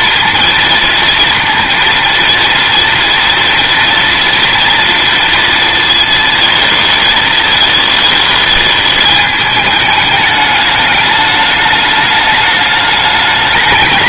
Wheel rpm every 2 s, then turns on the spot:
230, 230, 230, 220, 210, 210, 210.
none